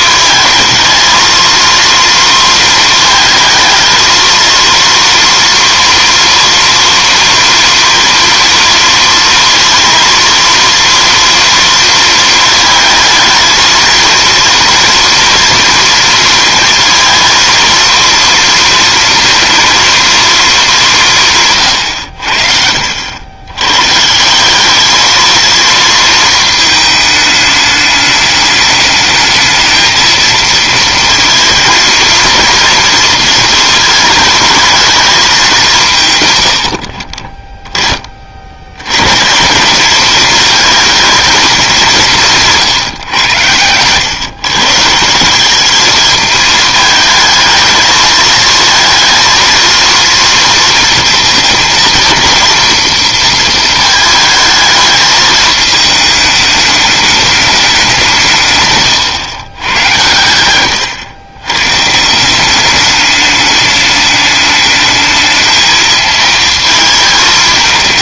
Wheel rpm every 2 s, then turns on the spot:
220, 230, 230, 230, 230, 230, 220, 230, 230, 230, 200, 70, 200, 220, 210, 230, 230, 220, 90, 90, 220, 150, 140, 220, 230, 230, 230, 220, 210, 130, 110, 200, 210, 220.
58-60